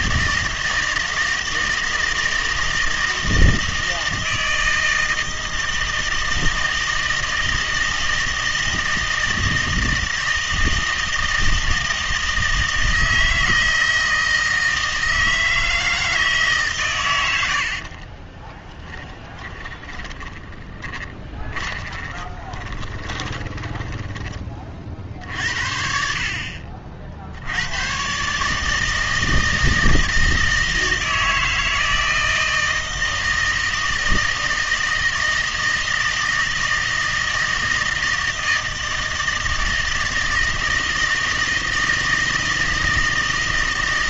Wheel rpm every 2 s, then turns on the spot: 160, 160, 160, 160, 160, 160, 160, 160, 150, 20, 20, 20, 40, 50, 150, 160, 160, 160, 160, 160, 160, 160.
18-24